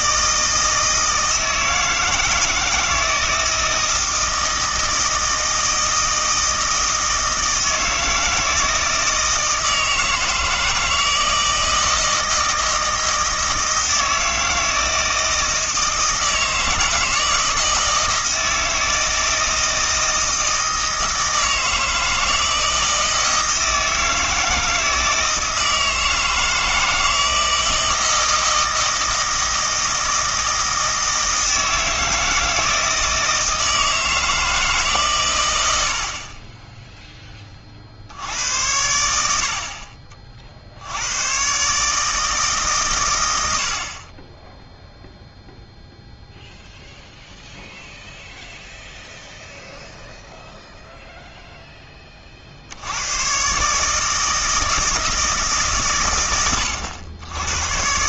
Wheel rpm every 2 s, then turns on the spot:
160, 160, 160, 160, 160, 160, 160, 160, 160, 160, 160, 160, 160, 160, 160, 160, 160, 150, 10, 90, 70, 130, 0, 0, 0, 0, 60, 160, 90.
none